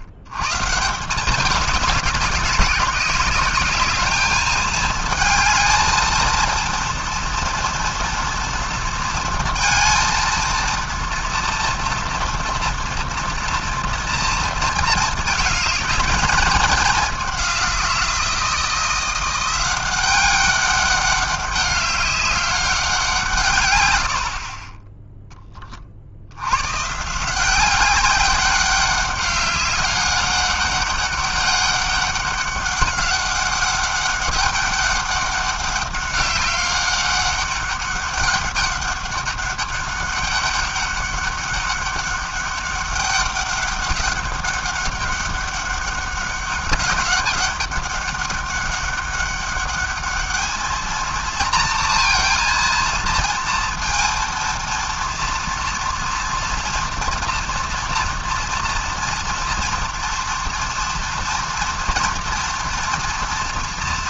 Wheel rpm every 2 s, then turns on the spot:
130, 190, 220, 230, 230, 230, 230, 230, 210, 170, 190, 200, 40, 110, 200, 200, 200, 200, 200, 200, 200, 200, 200, 200, 200, 220, 230, 230, 240, 230, 230, 240.
none